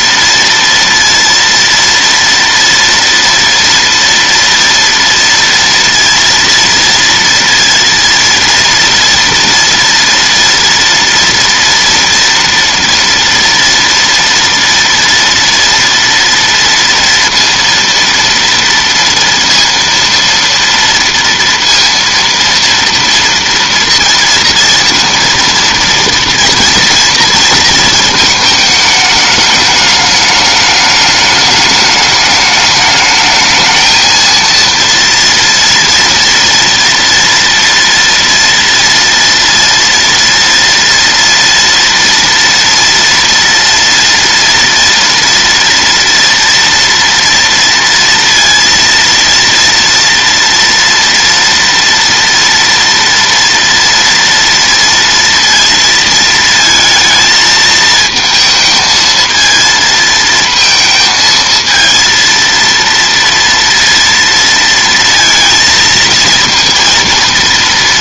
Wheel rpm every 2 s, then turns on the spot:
230, 230, 230, 230, 230, 230, 230, 230, 230, 230, 230, 230, 230, 230, 210, 210, 210, 230, 230, 230, 230, 230, 230, 230, 230, 230, 230, 230, 220, 230, 220, 230, 230, 230.
none